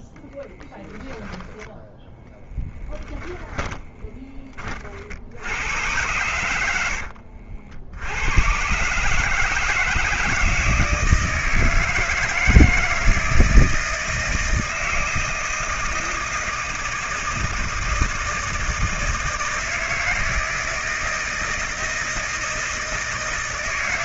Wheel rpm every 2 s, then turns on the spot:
10, 10, 50, 80, 140, 160, 160, 160, 160, 160, 160, 160.
0-4